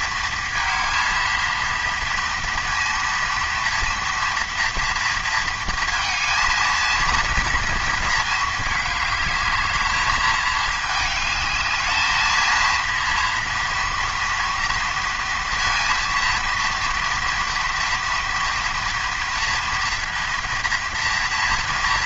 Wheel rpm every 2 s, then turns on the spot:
230, 230, 230, 230, 220, 220, 230, 230, 230, 230, 230.
none